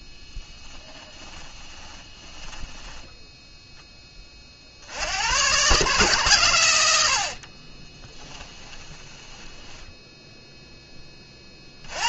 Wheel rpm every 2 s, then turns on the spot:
10, 10, 70, 90, 10, 0.
0-4 6-10